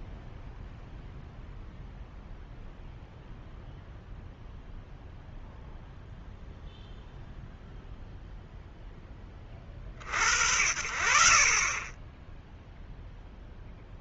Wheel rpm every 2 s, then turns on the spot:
0, 0, 0, 0, 20, 60, 0.
none